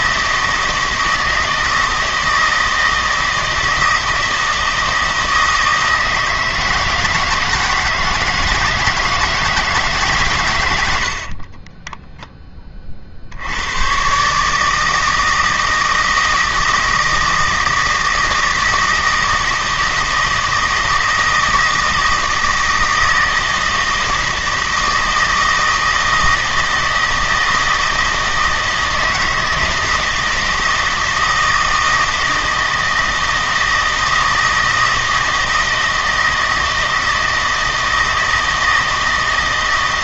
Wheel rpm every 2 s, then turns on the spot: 160, 160, 160, 160, 160, 100, 30, 160, 160, 160, 160, 160, 160, 160, 160, 160, 160, 160, 160, 160.
none